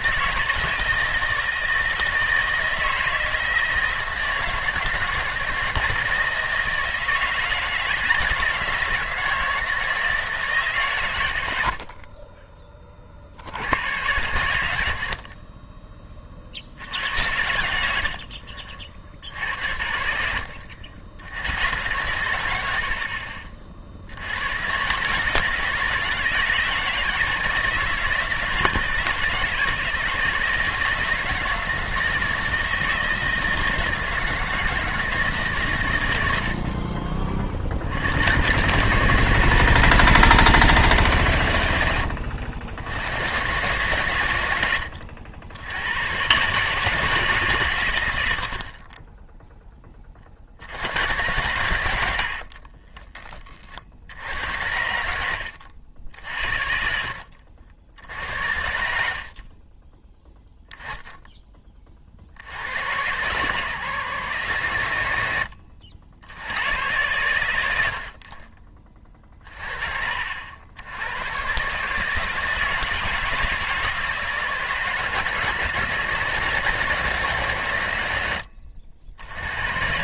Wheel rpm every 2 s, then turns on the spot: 160, 160, 160, 160, 170, 150, 30, 90, 50, 50, 70, 80, 120, 160, 160, 160, 160, 160, 60, 130, 160, 70, 100, 140, 50, 70, 40, 80, 60, 80, 10, 70, 90, 90, 30, 80, 160, 150, 160, 90.
18-20 52-54 58-60